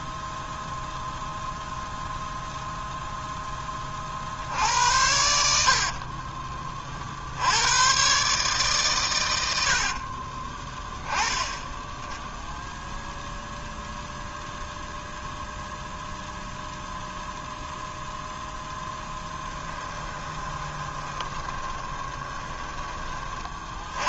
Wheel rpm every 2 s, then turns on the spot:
0, 0, 80, 50, 130, 20, 0, 0, 0, 10, 20, 20.
20-22